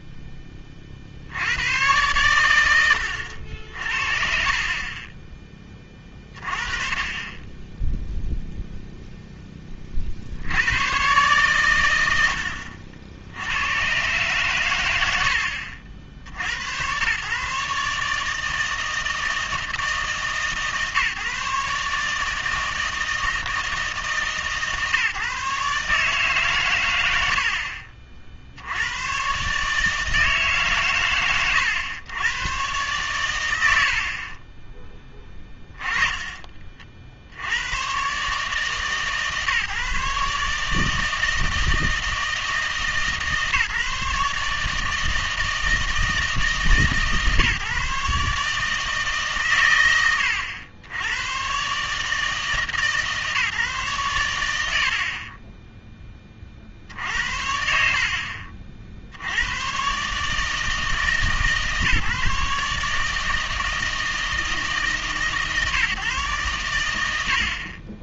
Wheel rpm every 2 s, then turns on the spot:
30, 100, 50, 20, 0, 100, 70, 120, 90, 160, 150, 160, 150, 130, 80, 140, 110, 20, 30, 150, 150, 150, 150, 150, 150, 90, 150, 80, 50, 50, 150, 140, 160, 100.
none